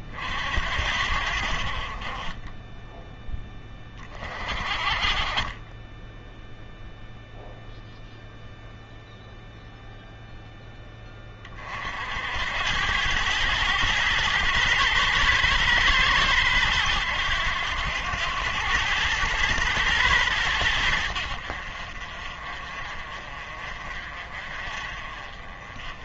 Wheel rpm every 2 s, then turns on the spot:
60, 10, 40, 0, 0, 10, 90, 110, 100, 100, 90, 40, 40.
none